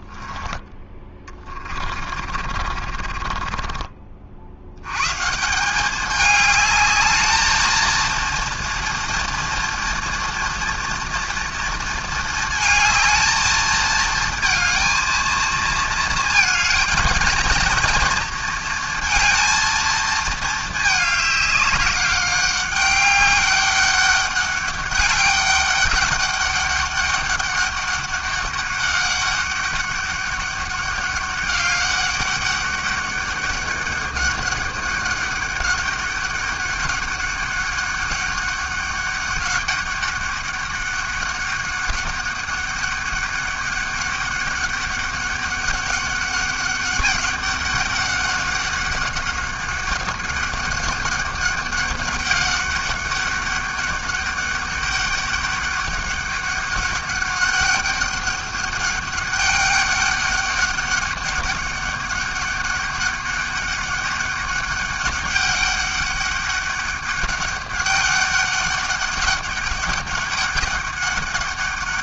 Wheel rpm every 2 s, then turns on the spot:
10, 40, 80, 210, 230, 230, 220, 230, 230, 230, 220, 200, 200, 200, 200, 200, 200, 200, 200, 200, 200, 200, 200, 200, 200, 200, 200, 200, 200, 200, 200, 200, 200, 200, 200, 200.
2-4